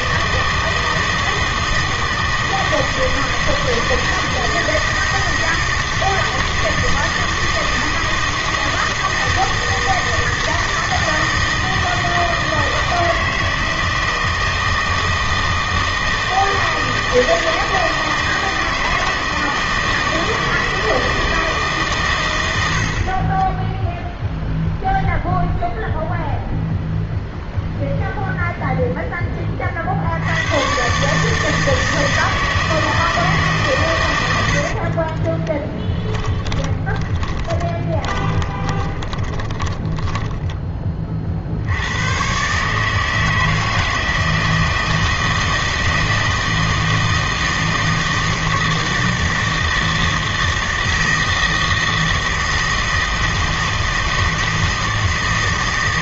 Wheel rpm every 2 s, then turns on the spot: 160, 160, 160, 160, 160, 160, 160, 160, 160, 160, 160, 80, 0, 0, 0, 120, 160, 60, 20, 20, 20, 150, 160, 160, 160, 160, 160, 160.
34-40